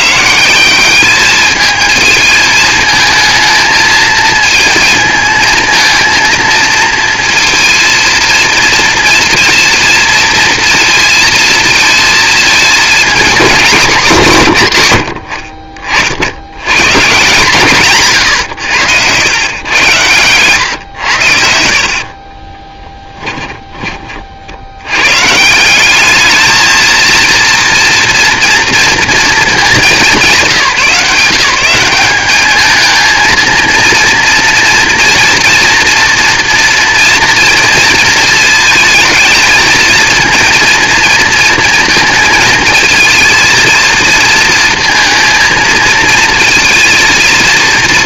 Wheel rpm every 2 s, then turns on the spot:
180, 220, 220, 230, 230, 230, 220, 160, 100, 120, 120, 20, 60, 220, 230, 180, 210, 230, 230, 220, 230, 220, 230, 230.
18-20 22-24